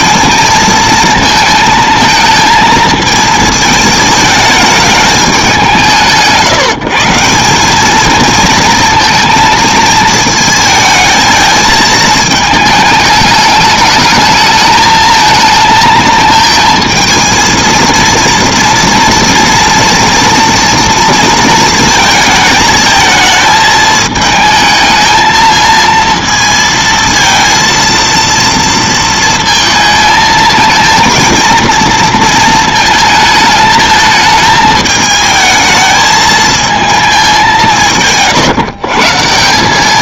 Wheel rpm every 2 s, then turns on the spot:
220, 230, 220, 170, 230, 220, 220, 220, 220, 230, 240, 220, 220, 230, 230, 220, 230, 220, 220, 150.
none